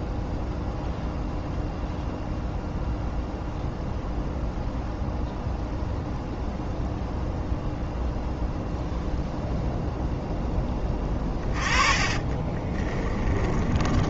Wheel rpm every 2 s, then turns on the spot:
0, 0, 0, 0, 0, 20, 20.
10-14